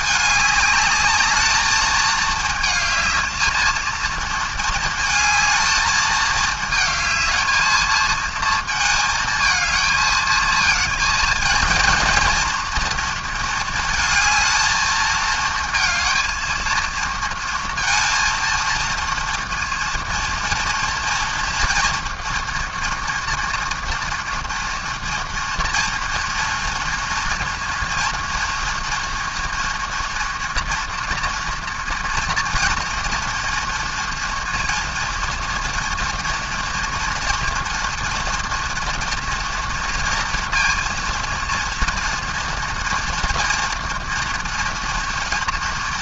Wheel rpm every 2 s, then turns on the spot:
210, 220, 220, 220, 220, 220, 230, 220, 230, 230, 230, 230, 230, 230, 230, 230, 230, 230, 230, 230, 230, 230, 230.
none